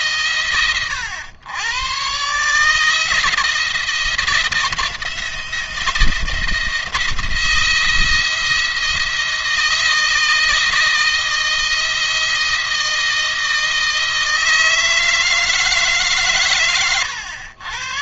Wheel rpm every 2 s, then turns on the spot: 120, 150, 170, 170, 170, 160, 160, 160, 120.
none